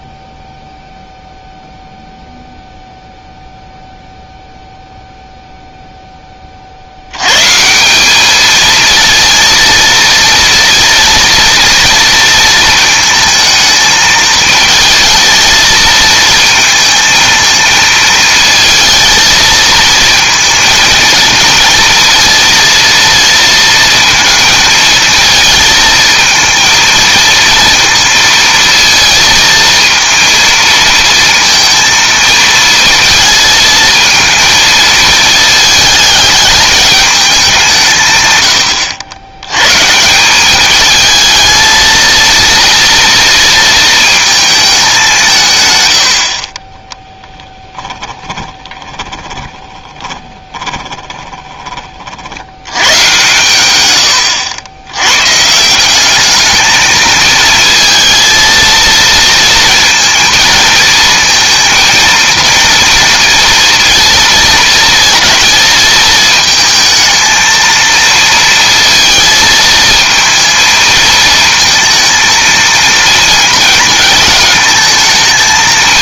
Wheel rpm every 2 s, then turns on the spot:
0, 0, 0, 60, 220, 230, 230, 220, 220, 220, 230, 230, 230, 220, 230, 230, 230, 230, 210, 100, 210, 230, 200, 20, 20, 20, 110, 90, 220, 230, 230, 230, 230, 220, 230, 230, 230, 220.
46-52